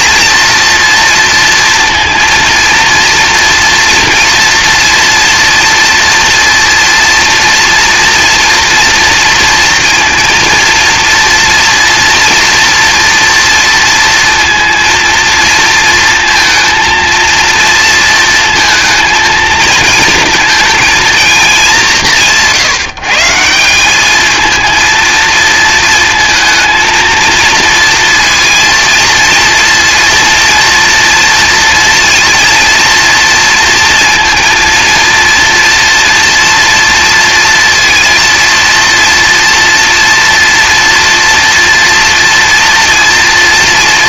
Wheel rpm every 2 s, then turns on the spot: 230, 230, 230, 230, 230, 230, 230, 230, 220, 230, 220, 170, 230, 230, 230, 230, 230, 230, 230, 230, 230, 230.
none